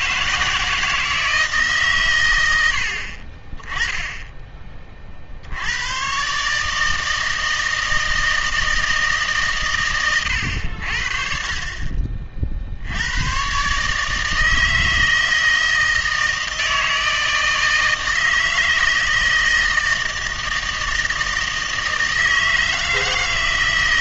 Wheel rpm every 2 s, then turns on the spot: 170, 80, 20, 150, 160, 90, 60, 160, 160, 160, 160, 160.
none